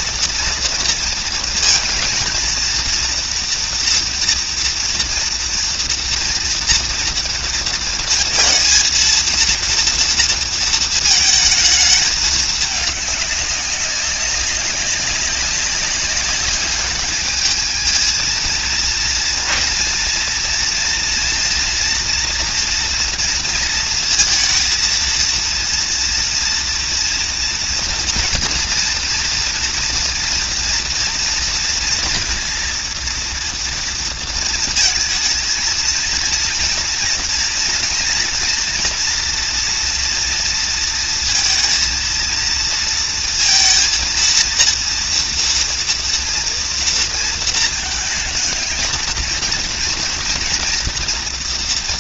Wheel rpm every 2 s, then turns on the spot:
230, 230, 240, 230, 230, 230, 210, 200, 210, 230, 230, 240, 230, 240, 240, 230, 230, 220, 230, 240, 230, 230, 230, 230, 220, 240.
none